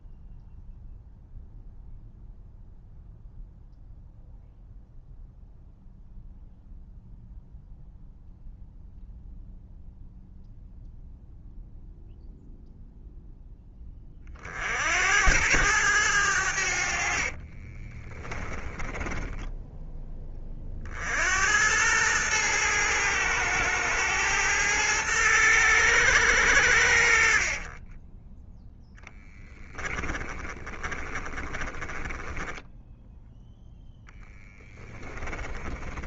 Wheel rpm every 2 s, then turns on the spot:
0, 0, 0, 0, 0, 0, 0, 60, 70, 10, 50, 110, 110, 80, 10, 30, 10, 20.
18-20 30-32 34-36